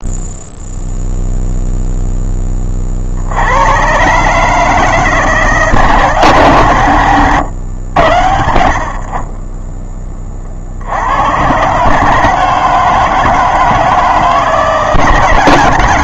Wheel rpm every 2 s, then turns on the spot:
0, 40, 160, 130, 70, 60, 160, 140.
none